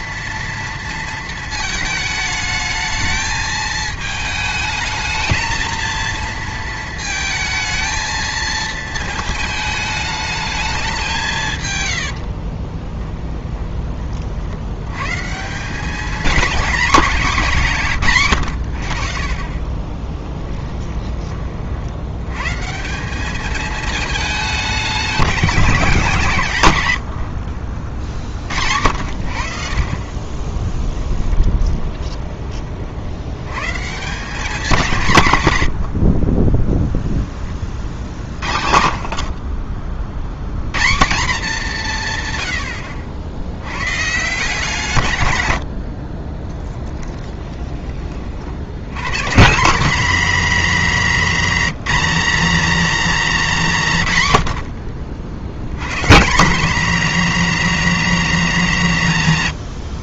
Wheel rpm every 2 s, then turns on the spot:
230, 220, 220, 220, 220, 210, 30, 90, 210, 80, 10, 170, 210, 110, 60, 10, 40, 180, 0, 30, 120, 80, 150, 20, 90, 210, 240, 80, 200, 170.
12-14 20-22 30-32 46-48